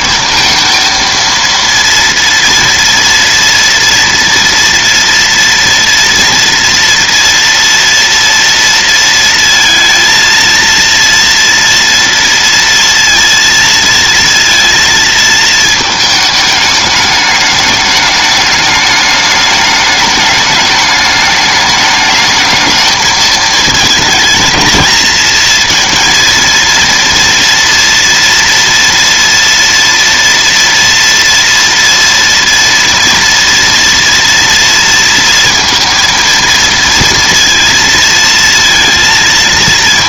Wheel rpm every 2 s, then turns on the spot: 230, 230, 230, 230, 230, 230, 230, 230, 210, 210, 210, 220, 220, 230, 230, 230, 230, 230, 230, 230.
none